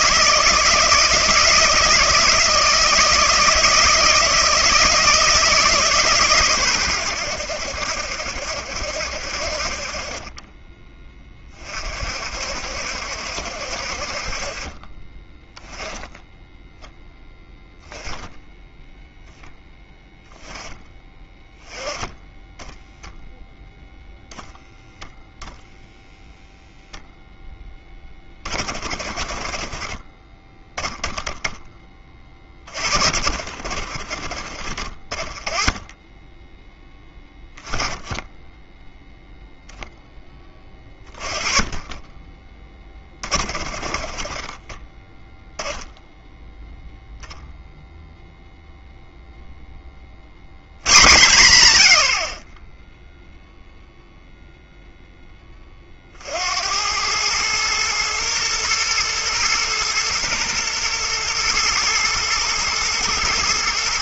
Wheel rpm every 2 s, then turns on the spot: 160, 160, 160, 110, 70, 20, 60, 30, 0, 0, 10, 10, 0, 0, 40, 20, 20, 40, 10, 10, 30, 20, 20, 0, 0, 100, 10, 0, 80, 110, 110, 110.
none